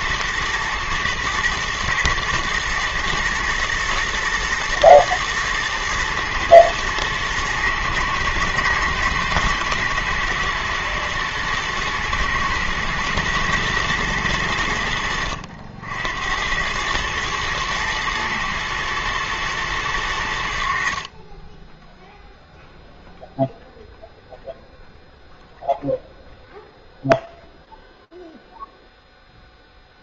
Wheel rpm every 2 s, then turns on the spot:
120, 120, 120, 110, 110, 110, 110, 90, 90, 110, 70, 0, 0, 0, 0.
none